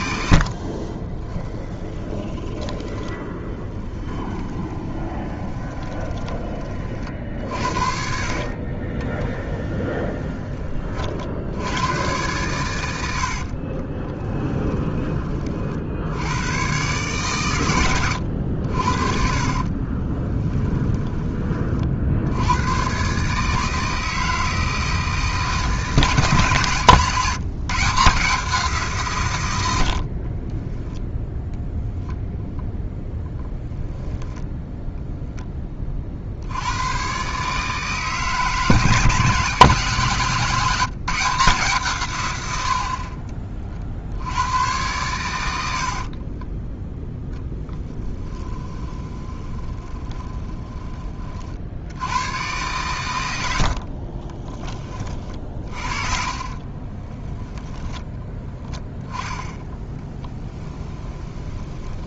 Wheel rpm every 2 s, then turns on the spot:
40, 30, 20, 40, 30, 40, 100, 20, 130, 60, 30, 120, 160, 140, 160, 10, 0, 0, 110, 160, 170, 60, 110, 10, 20, 20, 120, 20, 20, 10, 20.
0-6 8-10 20-22 30-32 48-50 56-58 60-62